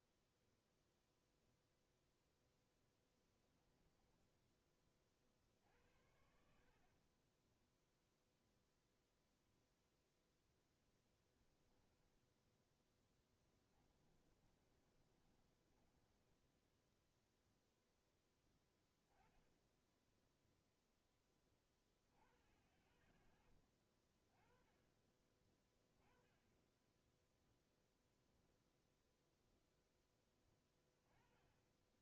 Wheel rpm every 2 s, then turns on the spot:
0, 10, 20, 60, 0, 10, 10, 20, 10, 10, 0, 10, 30, 20, 0, 10.
12-18